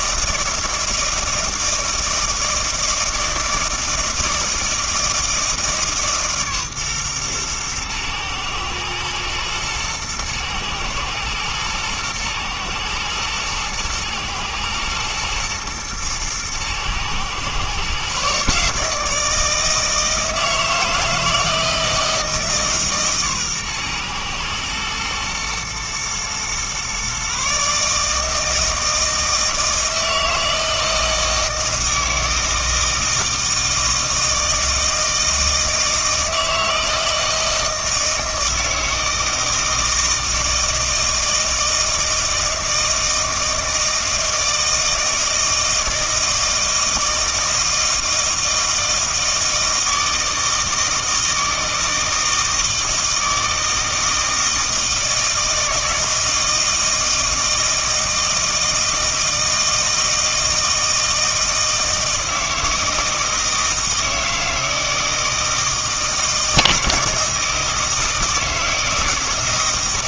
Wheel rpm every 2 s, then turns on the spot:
160, 160, 160, 130, 110, 110, 110, 110, 120, 150, 160, 150, 120, 130, 160, 160, 160, 160, 160, 160, 160, 160, 160, 160, 160, 160, 160, 160, 160, 160, 160, 160, 160, 160, 160.
none